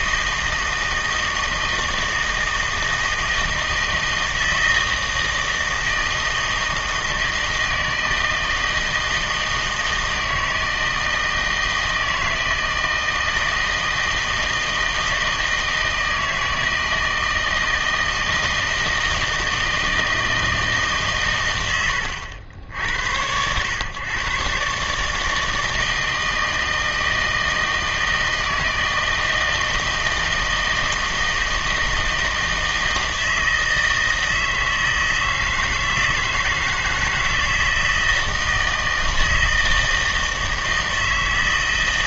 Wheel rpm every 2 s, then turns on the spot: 160, 160, 160, 160, 160, 160, 160, 160, 160, 160, 160, 80, 140, 160, 160, 160, 160, 160, 160, 160, 160.
none